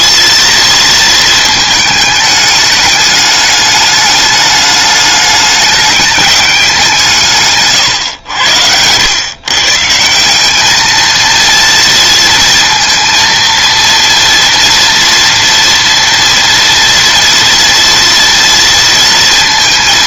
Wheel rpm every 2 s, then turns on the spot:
230, 210, 210, 170, 100, 220, 230, 230, 230, 230.
none